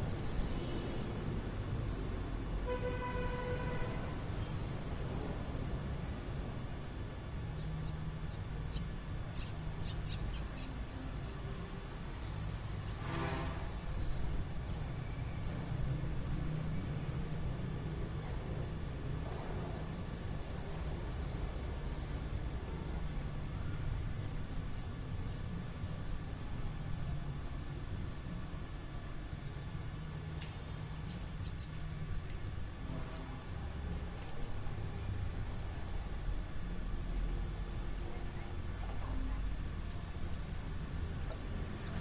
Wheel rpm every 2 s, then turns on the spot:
0, 0, 0, 0, 0, 0, 0, 0, 0, 0, 0, 0, 0, 0, 0, 0, 0, 0, 0, 0, 0.
none